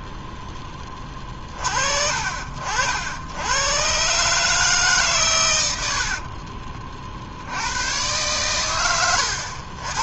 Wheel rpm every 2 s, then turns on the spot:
10, 60, 150, 40, 110.
6-8